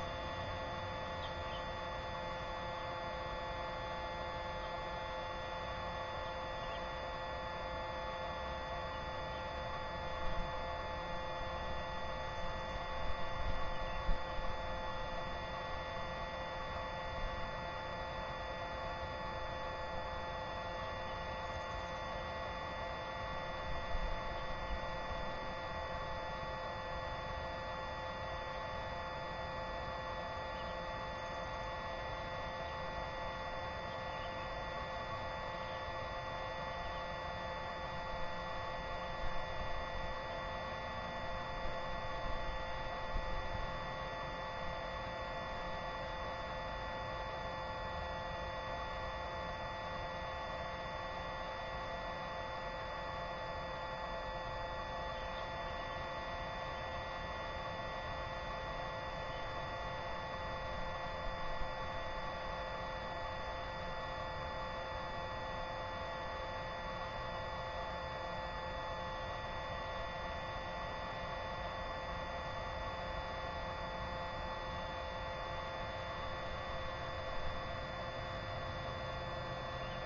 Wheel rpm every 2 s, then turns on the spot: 0, 0, 0, 0, 0, 0, 0, 0, 0, 0, 0, 0, 0, 0, 0, 0, 0, 0, 0, 0, 0, 0, 0, 0, 0, 0, 0, 0, 0, 0, 0, 0, 0, 0, 0, 0, 0, 0, 0, 0.
none